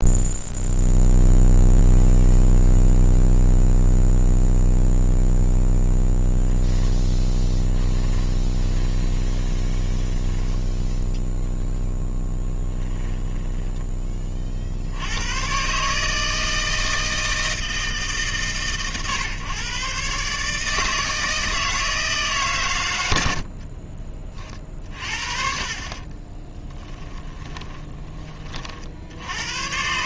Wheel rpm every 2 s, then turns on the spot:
0, 0, 0, 10, 20, 10, 10, 60, 160, 130, 150, 130, 40, 20, 50.
6-14 26-28